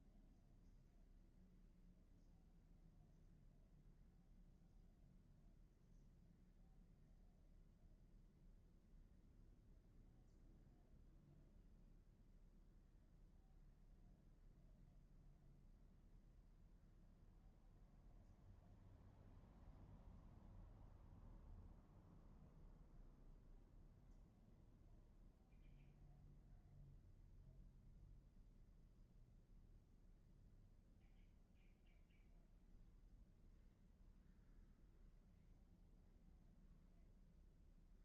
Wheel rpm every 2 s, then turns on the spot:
0, 0, 0, 0, 0, 0, 0, 0, 0, 0, 0, 0, 0, 0, 0, 0, 0, 0, 0.
none